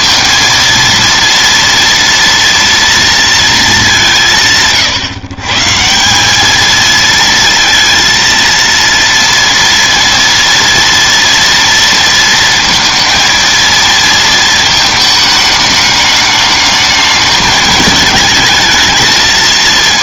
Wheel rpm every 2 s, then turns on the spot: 230, 230, 140, 220, 230, 230, 230, 220, 210, 220.
none